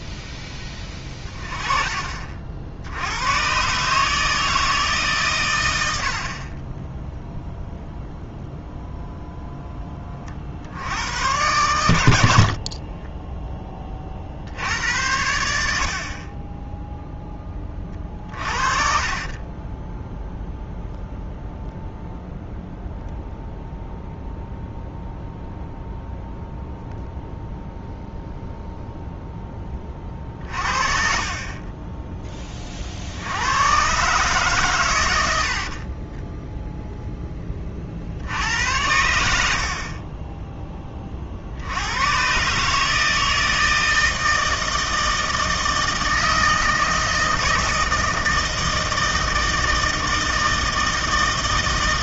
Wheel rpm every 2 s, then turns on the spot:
20, 70, 160, 10, 0, 70, 30, 70, 10, 30, 0, 0, 0, 0, 0, 40, 30, 120, 0, 80, 10, 140, 160, 160, 160, 160.
6-8 12-14 30-32